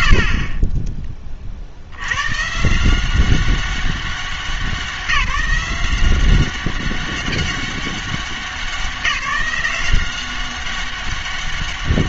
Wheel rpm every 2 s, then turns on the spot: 60, 150, 190, 190, 190, 190.
none